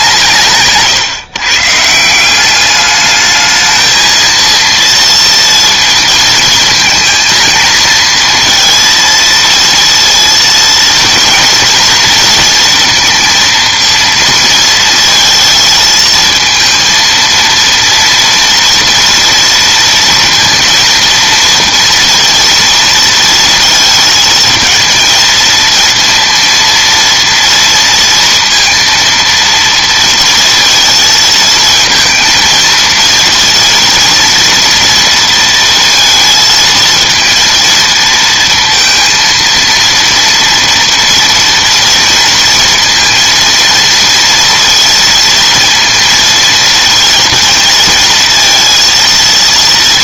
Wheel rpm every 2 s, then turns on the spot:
140, 200, 230, 220, 230, 230, 230, 230, 230, 230, 230, 230, 230, 230, 230, 230, 230, 230, 220, 230, 230, 220, 230, 230, 230.
none